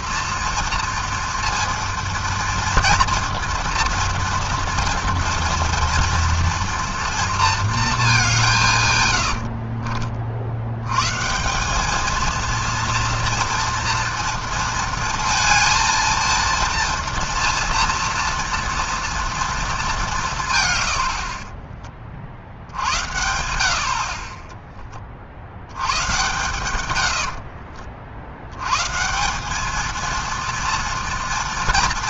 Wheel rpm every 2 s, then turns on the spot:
230, 230, 230, 230, 150, 110, 230, 230, 230, 240, 110, 80, 30, 120, 120, 230.
none